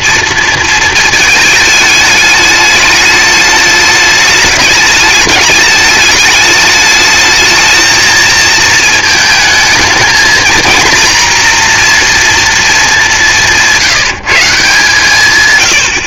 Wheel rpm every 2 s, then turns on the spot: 230, 210, 210, 210, 220, 220, 230, 160.
none